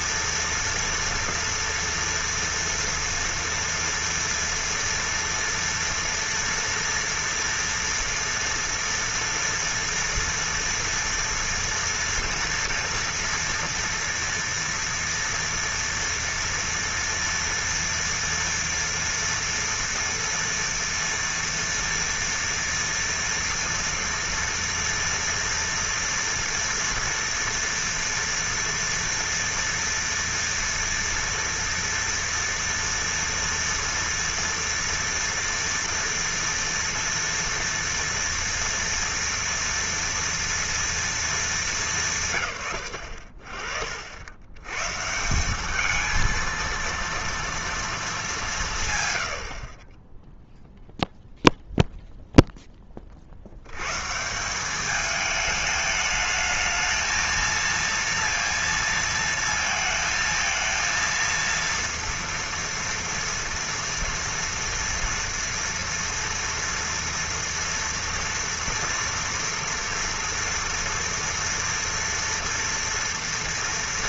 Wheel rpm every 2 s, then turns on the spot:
240, 230, 240, 230, 240, 230, 230, 230, 230, 230, 230, 230, 230, 230, 230, 230, 240, 230, 230, 230, 230, 110, 120, 230, 150, 0, 10, 190, 220, 230, 230, 240, 240, 230, 230, 230, 230.
none